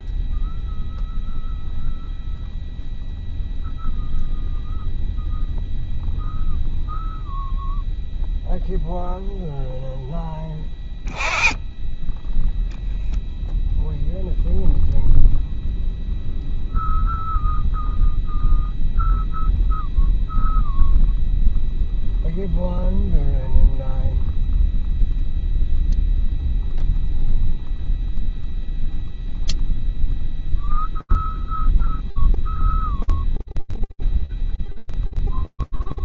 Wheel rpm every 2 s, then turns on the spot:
0, 0, 0, 0, 0, 0, 0, 0, 0, 0, 0, 0, 0, 0, 0, 0, 0, 0.
none